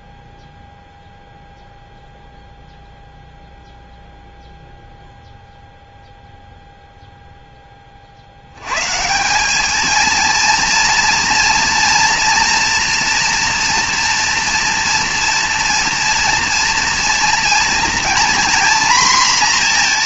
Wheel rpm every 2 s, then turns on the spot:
0, 0, 0, 0, 100, 230, 230, 230, 230, 240.
none